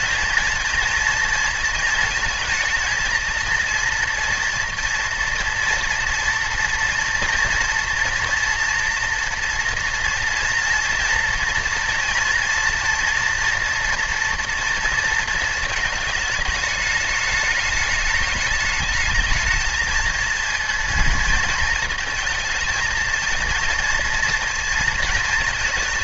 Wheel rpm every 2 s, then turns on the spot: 230, 220, 230, 240, 230, 230, 230, 230, 210, 210, 230, 230, 230.
none